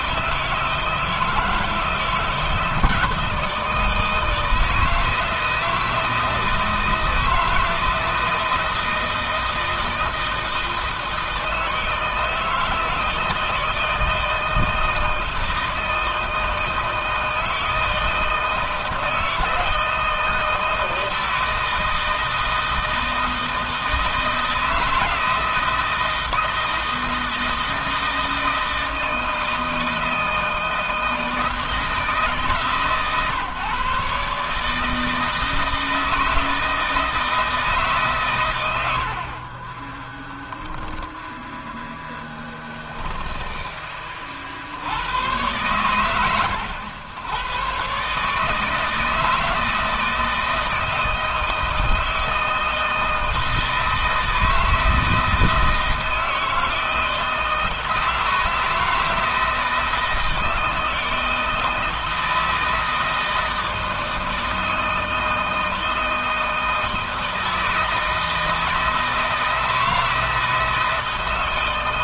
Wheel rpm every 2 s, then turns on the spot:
160, 160, 160, 160, 160, 160, 160, 160, 160, 160, 160, 160, 160, 160, 160, 160, 150, 150, 160, 100, 10, 10, 90, 90, 160, 160, 160, 160, 160, 160, 160, 160, 160, 160, 160, 160.
42-44